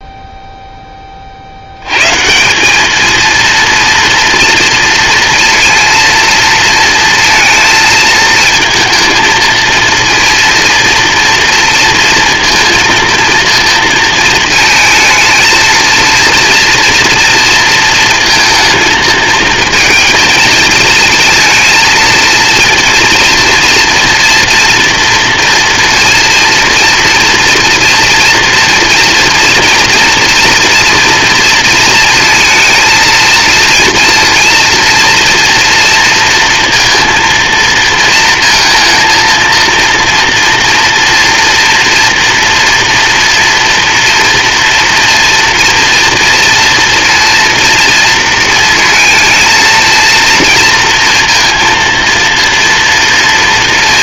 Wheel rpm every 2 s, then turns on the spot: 50, 230, 230, 230, 230, 230, 230, 220, 230, 220, 230, 230, 230, 240, 230, 230, 230, 240, 230, 230, 230, 240, 240, 230, 230, 230, 230.
none